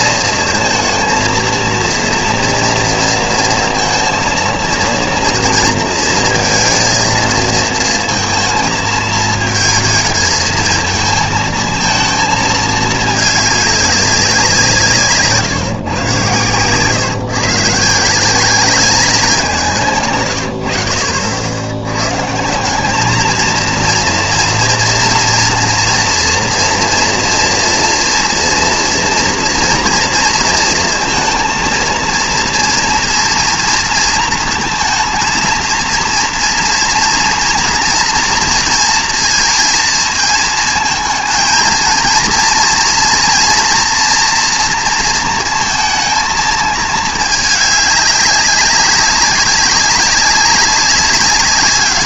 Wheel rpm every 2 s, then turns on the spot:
230, 230, 230, 230, 220, 220, 220, 180, 120, 190, 100, 180, 230, 230, 240, 230, 230, 230, 230, 230, 220, 230, 230, 220, 190, 200.
none